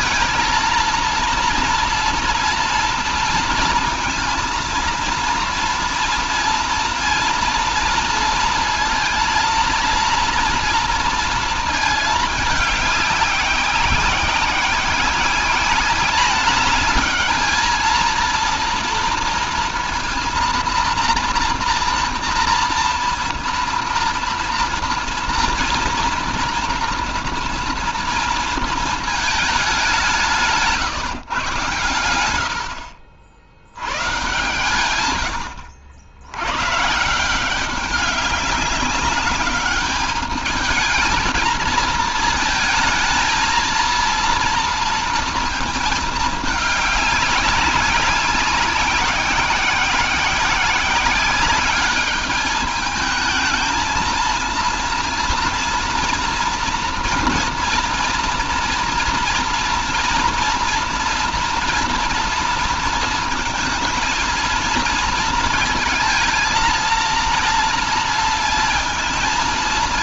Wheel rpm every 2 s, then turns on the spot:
230, 230, 230, 230, 230, 230, 210, 190, 210, 230, 230, 230, 230, 230, 230, 150, 80, 120, 110, 200, 220, 230, 230, 210, 200, 180, 210, 230, 230, 240, 230, 230, 230, 230, 230.
none